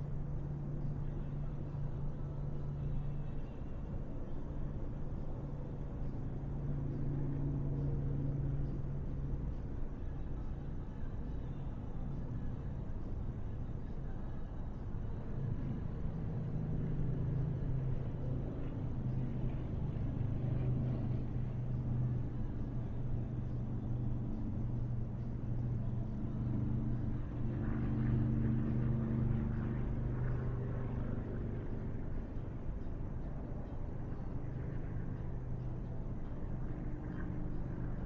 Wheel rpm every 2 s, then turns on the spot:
0, 0, 0, 0, 0, 0, 0, 0, 0, 0, 0, 0, 0, 0, 0, 0, 0, 0, 0.
none